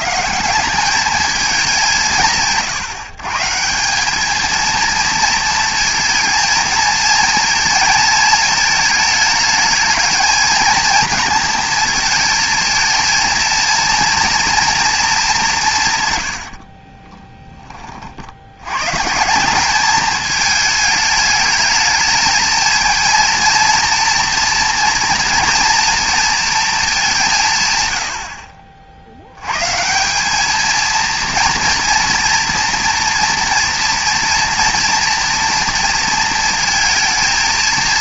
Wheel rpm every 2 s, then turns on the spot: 200, 150, 220, 230, 220, 220, 220, 230, 60, 110, 220, 230, 230, 210, 50, 220, 230, 230, 230.
16-18